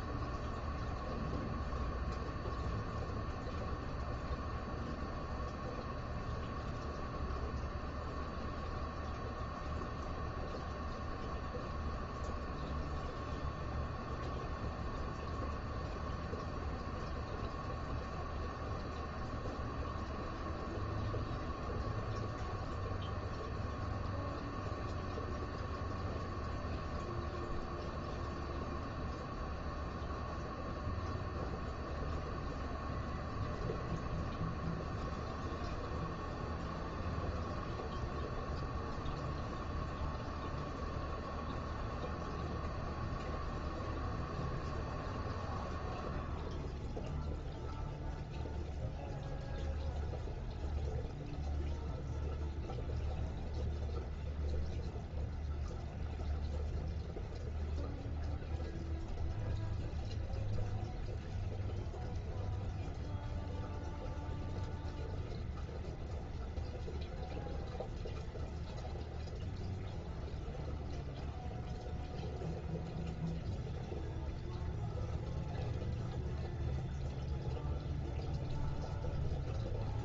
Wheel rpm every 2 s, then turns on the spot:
0, 0, 0, 0, 0, 0, 0, 0, 0, 0, 0, 0, 0, 0, 0, 0, 0, 0, 0, 0, 0, 0, 0, 0, 0, 0, 0, 0, 0, 0, 0, 0, 0, 0, 0, 0, 0, 0, 0, 0.
none